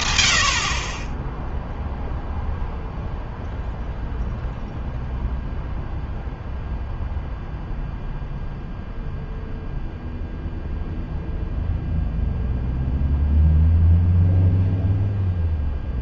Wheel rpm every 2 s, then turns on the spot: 30, 0, 0, 0, 0, 0, 0, 0.
none